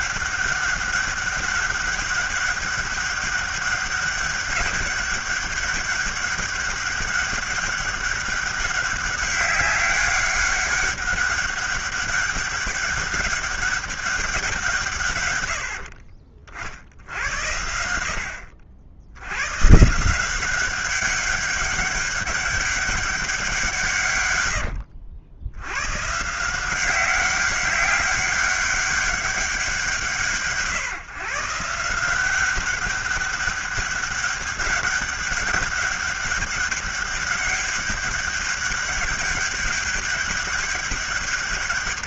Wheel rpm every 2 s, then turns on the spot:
190, 200, 200, 200, 190, 200, 200, 170, 60, 70, 190, 200, 90, 170, 200, 140, 190, 200, 200, 200, 200.
24-26